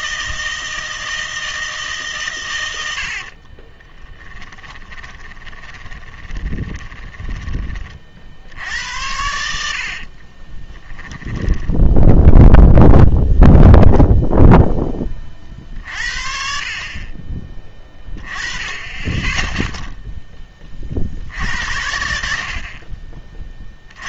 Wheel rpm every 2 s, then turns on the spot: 160, 100, 20, 20, 70, 20, 0, 10, 40, 20, 30, 50.
4-8 10-12